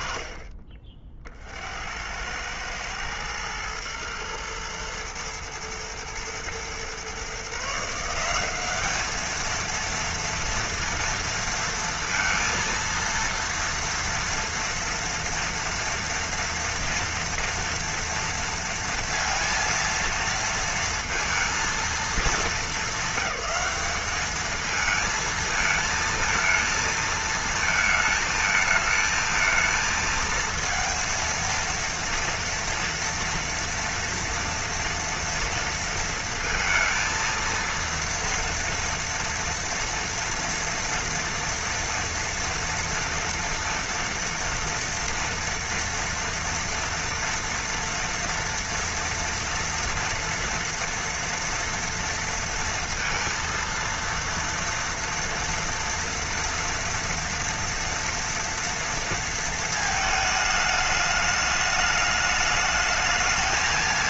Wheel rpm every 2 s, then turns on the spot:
40, 100, 110, 120, 190, 230, 230, 230, 240, 230, 230, 210, 220, 220, 220, 230, 230, 230, 230, 230, 230, 230, 230, 230, 230, 230, 230, 230, 230, 230, 220, 210.
none